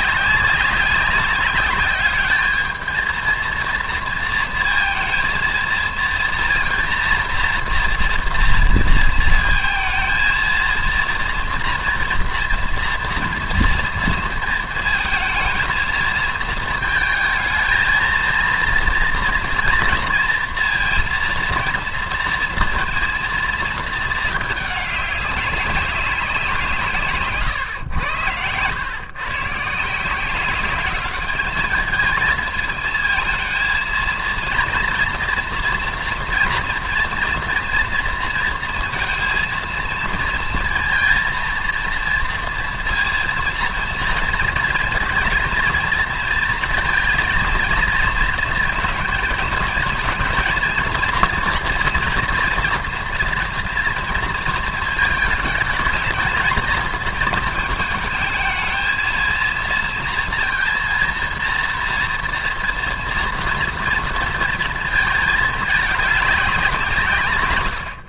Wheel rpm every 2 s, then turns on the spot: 190, 220, 230, 230, 230, 230, 240, 230, 220, 230, 230, 230, 200, 160, 120, 200, 220, 230, 230, 230, 230, 230, 240, 230, 220, 230, 230, 220, 220, 220, 230, 230, 220, 170.
none